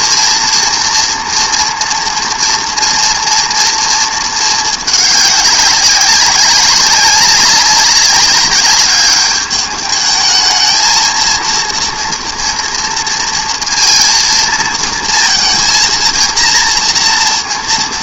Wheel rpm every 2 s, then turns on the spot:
230, 230, 200, 200, 200, 220, 230, 230, 230.
none